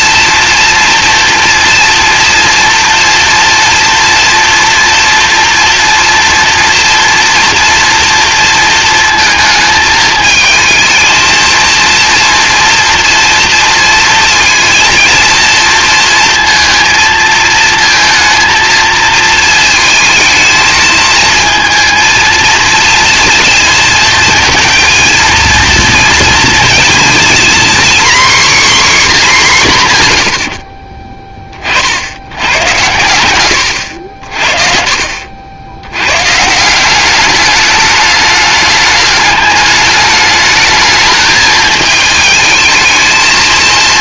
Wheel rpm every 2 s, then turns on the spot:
230, 230, 230, 230, 230, 220, 240, 230, 230, 230, 220, 230, 230, 230, 250, 80, 100, 40, 170, 210, 210, 220.
30-32